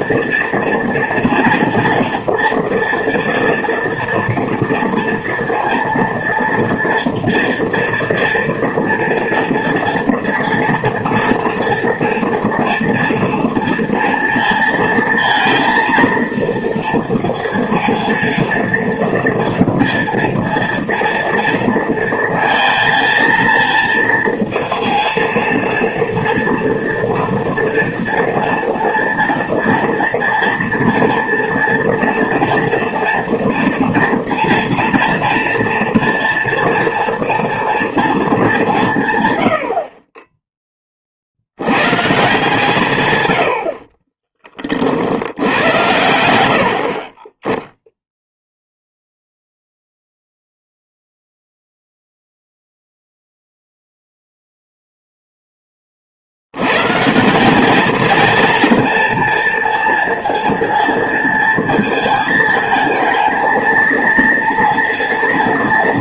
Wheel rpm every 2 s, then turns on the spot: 230, 230, 230, 230, 230, 230, 230, 230, 230, 230, 230, 230, 230, 230, 230, 230, 230, 230, 230, 190, 20, 150, 30, 60, 0, 0, 0, 0, 100, 230, 230, 220, 230.
none